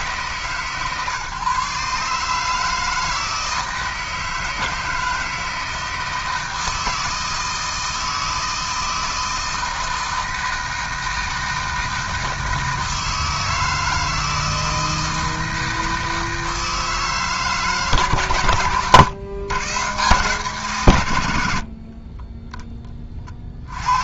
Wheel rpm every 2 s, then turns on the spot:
140, 160, 160, 160, 160, 160, 160, 160, 160, 120, 130, 20.
none